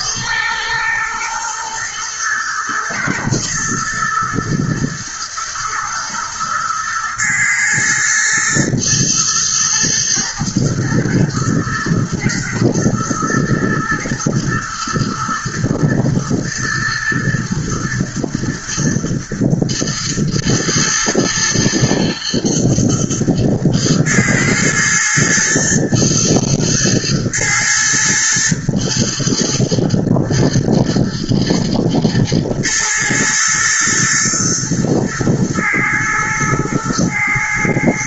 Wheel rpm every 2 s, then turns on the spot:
110, 120, 120, 120, 110, 120, 110, 110, 120, 120, 120, 110, 120, 110, 120, 110, 110, 110, 110.
none